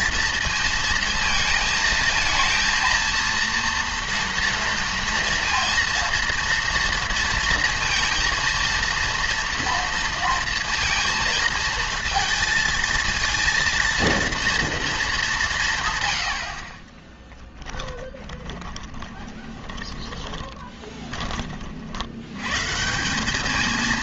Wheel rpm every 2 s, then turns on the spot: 230, 230, 230, 230, 230, 230, 230, 230, 50, 20, 20, 140.
18-22